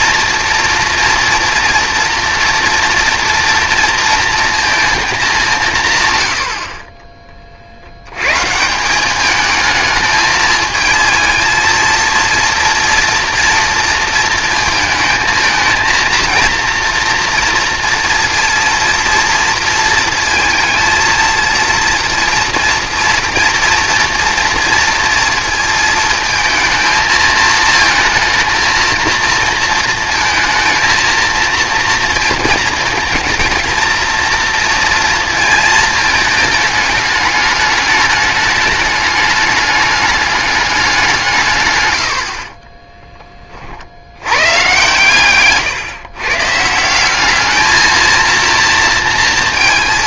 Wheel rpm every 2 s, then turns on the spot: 230, 230, 230, 40, 170, 220, 230, 220, 230, 230, 220, 230, 230, 220, 230, 230, 230, 230, 210, 210, 200, 20, 130, 150, 230.
42-44